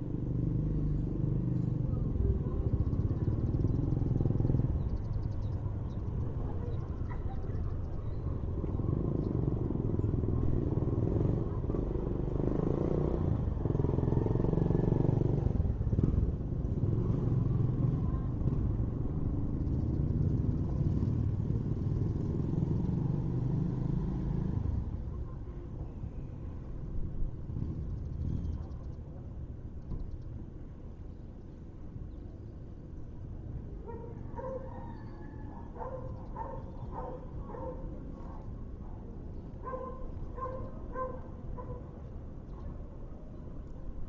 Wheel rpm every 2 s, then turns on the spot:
0, 0, 0, 0, 0, 0, 0, 0, 0, 0, 0, 0, 0, 0, 0, 0, 0, 0, 0, 0, 0, 0.
none